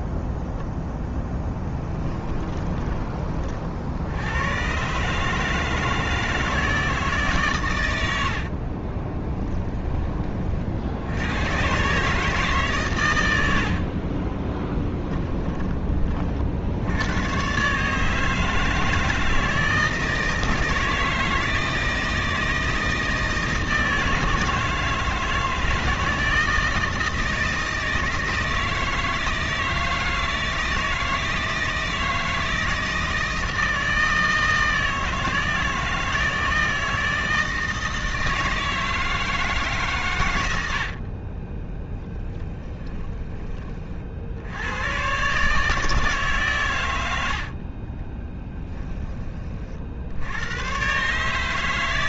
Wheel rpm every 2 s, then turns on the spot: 10, 20, 120, 160, 40, 60, 140, 10, 70, 160, 160, 160, 150, 160, 160, 160, 160, 160, 160, 160, 70, 20, 90, 120, 10, 110.
8-10 14-16 42-44 48-50